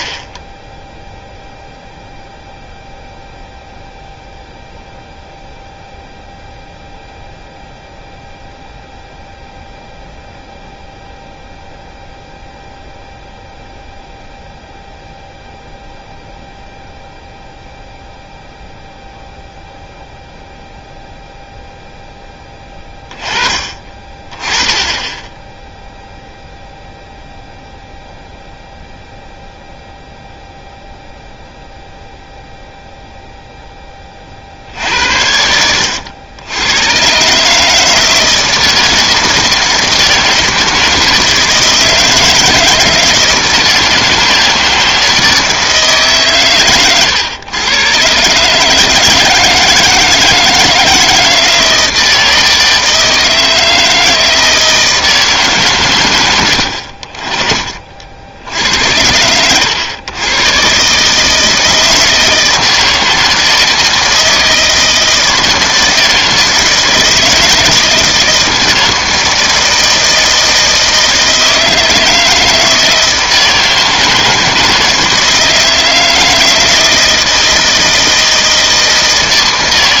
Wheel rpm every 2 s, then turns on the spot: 10, 0, 0, 0, 0, 0, 0, 0, 0, 0, 0, 10, 20, 0, 0, 0, 0, 60, 100, 160, 160, 160, 160, 120, 150, 160, 160, 160, 70, 90, 130, 160, 160, 160, 160, 160, 160, 160, 160, 160.
none